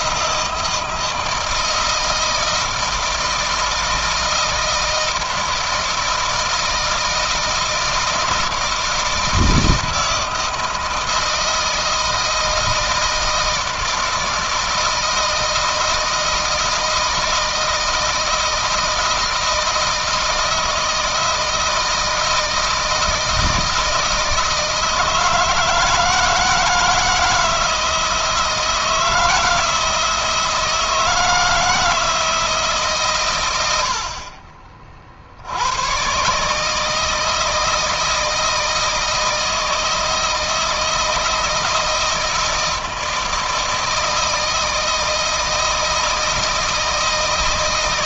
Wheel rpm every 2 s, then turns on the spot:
160, 160, 160, 160, 160, 160, 160, 160, 160, 160, 160, 160, 160, 160, 160, 160, 140, 40, 150, 160, 160, 160, 160, 160.
none